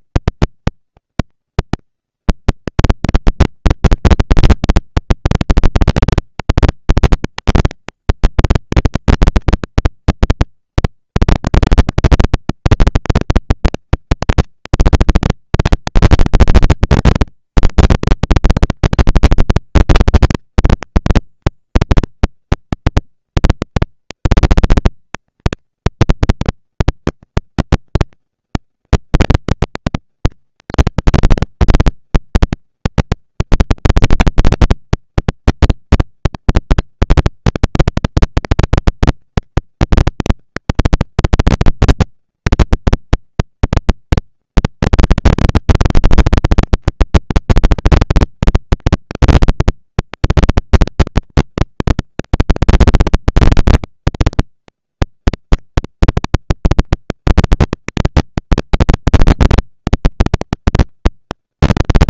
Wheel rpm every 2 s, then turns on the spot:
220, 230, 230, 230, 230, 230, 230, 220, 230, 230, 230, 230, 230, 230, 230, 220, 190, 210, 230, 230, 230, 230, 230, 230, 230, 240, 230, 230, 230, 230, 230.
none